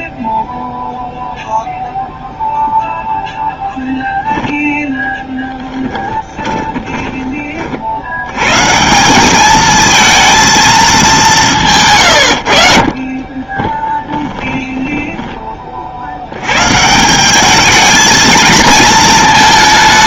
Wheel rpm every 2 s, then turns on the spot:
0, 0, 0, 20, 160, 220, 60, 10, 130, 230.
6-8 14-16